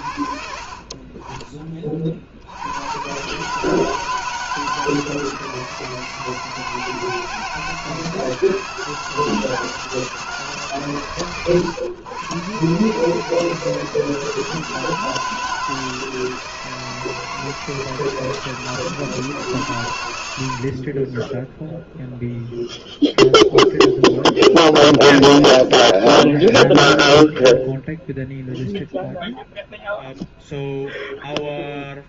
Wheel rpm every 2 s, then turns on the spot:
40, 80, 160, 160, 160, 150, 130, 160, 160, 160, 60, 0, 0, 0, 0, 0.
none